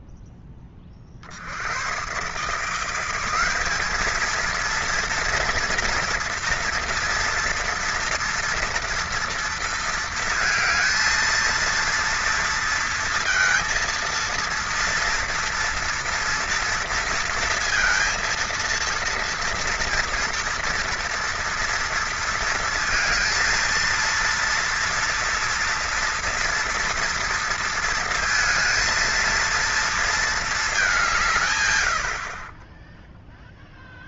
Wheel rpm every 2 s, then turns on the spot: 10, 150, 220, 230, 230, 230, 230, 230, 230, 230, 240, 230, 230, 230, 230, 210, 30.
none